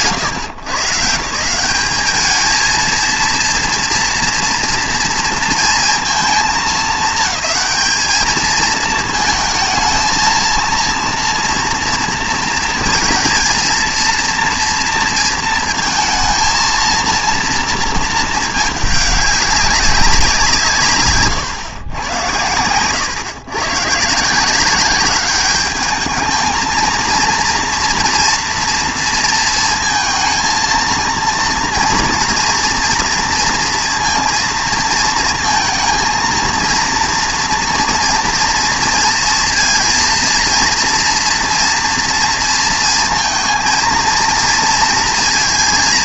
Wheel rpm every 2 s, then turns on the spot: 150, 220, 230, 220, 220, 230, 230, 230, 230, 210, 140, 110, 190, 230, 230, 230, 230, 230, 230, 230, 230, 230, 230.
none